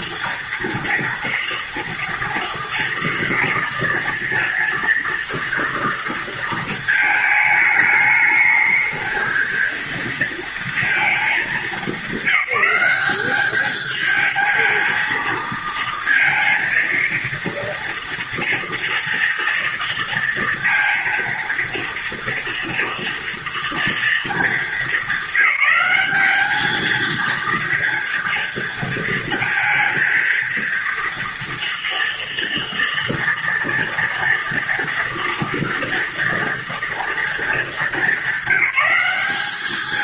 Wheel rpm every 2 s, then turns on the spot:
230, 230, 230, 220, 220, 230, 190, 220, 230, 230, 230, 230, 220, 220, 230, 230, 240, 230, 230, 190.
none